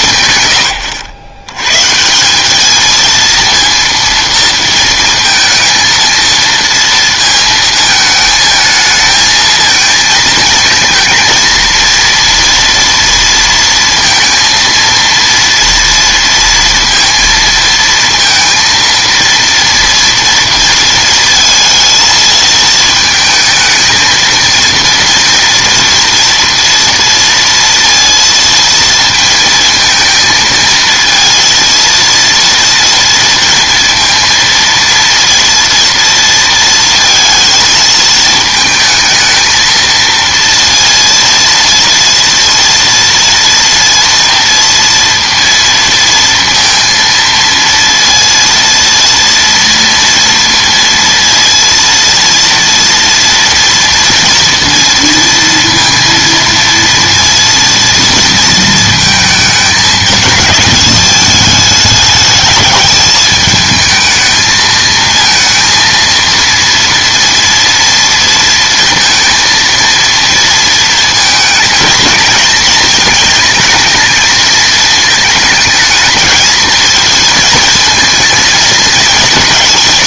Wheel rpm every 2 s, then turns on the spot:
120, 210, 230, 230, 220, 220, 230, 230, 230, 230, 230, 220, 230, 230, 230, 230, 230, 230, 230, 220, 230, 230, 230, 230, 230, 230, 230, 230, 230, 220, 220, 210, 220, 230, 230, 230, 220, 220, 220, 220.
none